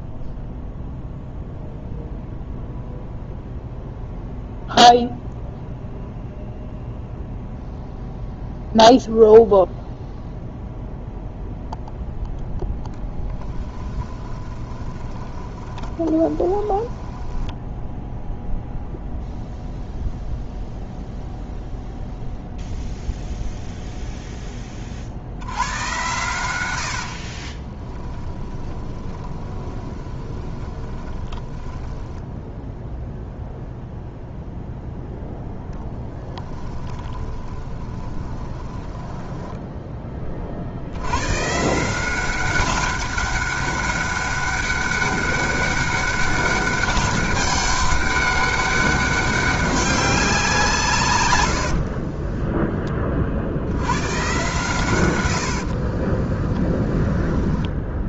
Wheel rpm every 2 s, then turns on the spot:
0, 0, 0, 0, 0, 0, 0, 20, 20, 0, 0, 0, 20, 90, 20, 20, 0, 0, 30, 20, 60, 190, 200, 200, 200, 160, 10, 130, 10.
14-18 26-32 36-40 56-58